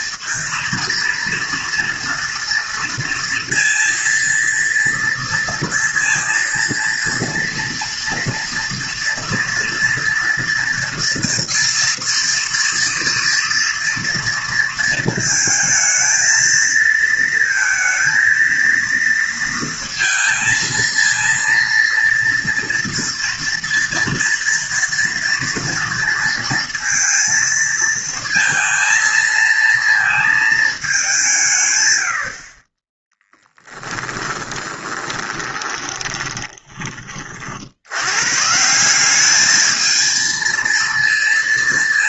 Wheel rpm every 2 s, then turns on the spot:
230, 230, 230, 230, 240, 240, 230, 230, 230, 230, 230, 230, 230, 230, 230, 210, 20, 10, 20, 160, 230.
34-36